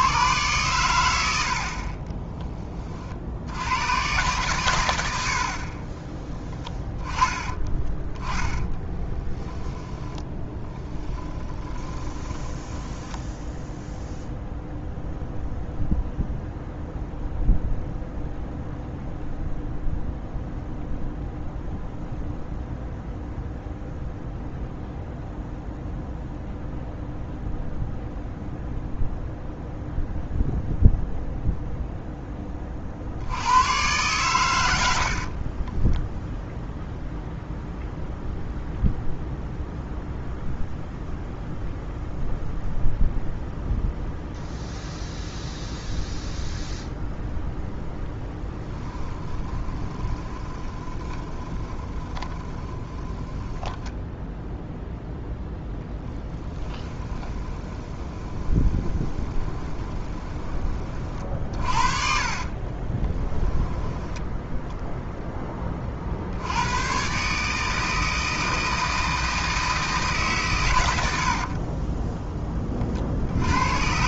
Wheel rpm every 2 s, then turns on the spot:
110, 20, 110, 10, 10, 20, 10, 0, 0, 0, 0, 0, 0, 0, 0, 0, 40, 90, 0, 0, 0, 0, 0, 0, 10, 20, 20, 0, 20, 20, 30, 30, 0, 100, 160, 120, 30.
8-12 48-54 56-60 62-64